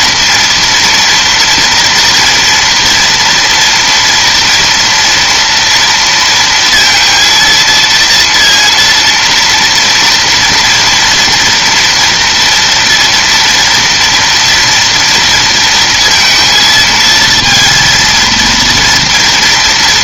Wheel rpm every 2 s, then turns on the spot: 230, 230, 240, 230, 230, 230, 230, 230, 230, 230.
none